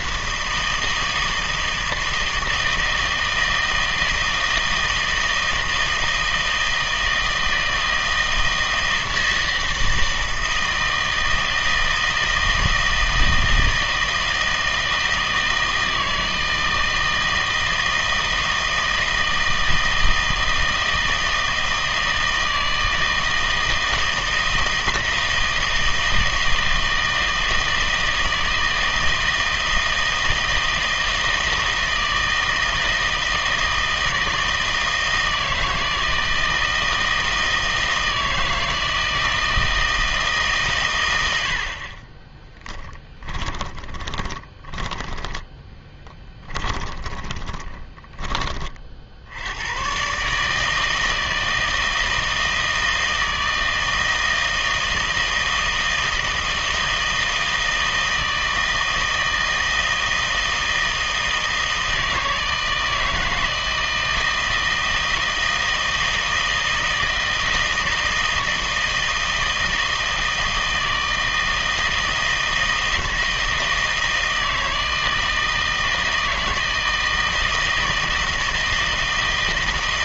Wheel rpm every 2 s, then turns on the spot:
160, 160, 160, 160, 160, 160, 160, 160, 160, 160, 160, 160, 160, 160, 160, 160, 160, 160, 160, 160, 130, 30, 20, 20, 30, 160, 160, 160, 160, 160, 160, 160, 160, 160, 160, 160, 160, 160, 160, 160.
42-48